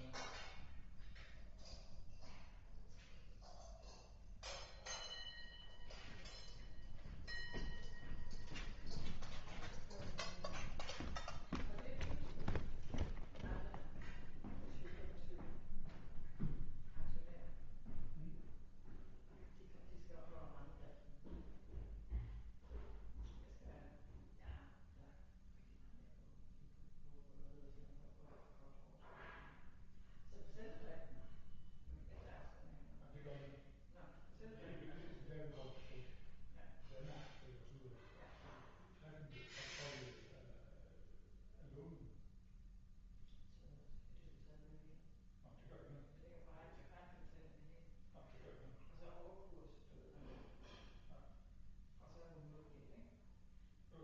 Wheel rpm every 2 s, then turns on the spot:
0, 0, 0, 0, 0, 0, 0, 0, 0, 0, 0, 0, 0, 0, 0, 0, 0, 0, 0, 0, 0, 0, 0, 0, 0, 0, 0.
none